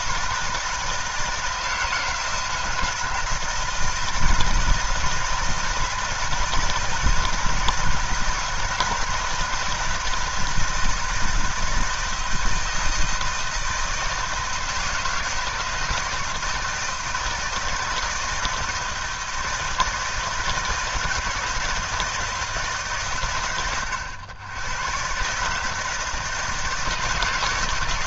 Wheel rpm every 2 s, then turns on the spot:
160, 160, 160, 160, 160, 160, 160, 160, 170, 160, 160, 160, 110, 160.
none